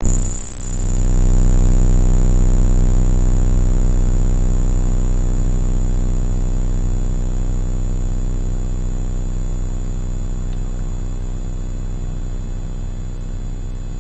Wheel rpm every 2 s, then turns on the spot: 0, 0, 0, 0, 0, 0, 0.
none